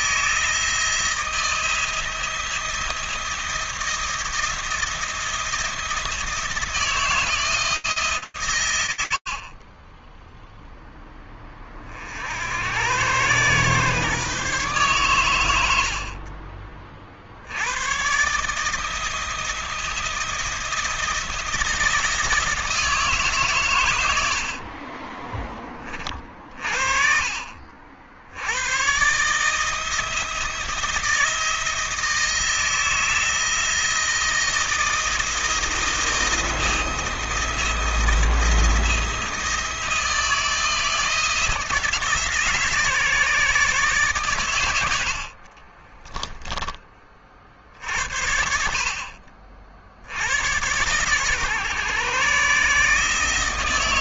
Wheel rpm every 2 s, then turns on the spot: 160, 170, 170, 160, 110, 0, 90, 130, 40, 160, 170, 160, 30, 50, 130, 170, 160, 170, 170, 170, 160, 150, 70, 40, 50, 120, 150.
24-26 44-46